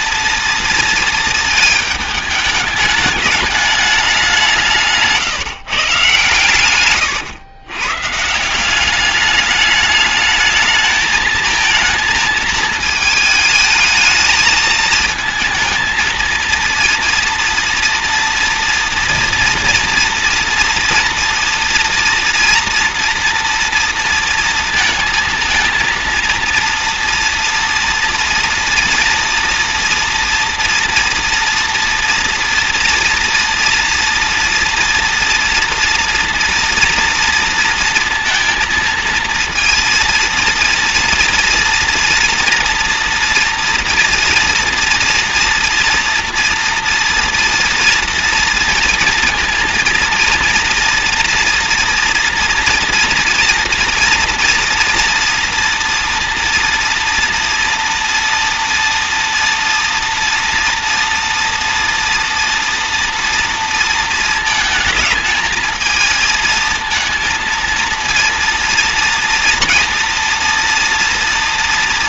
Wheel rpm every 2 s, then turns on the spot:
230, 210, 190, 120, 170, 210, 220, 220, 230, 230, 240, 230, 230, 230, 230, 230, 230, 230, 230, 230, 230, 240, 230, 230, 230, 230, 230, 230, 230, 230, 230, 230, 220, 220, 230, 230.
none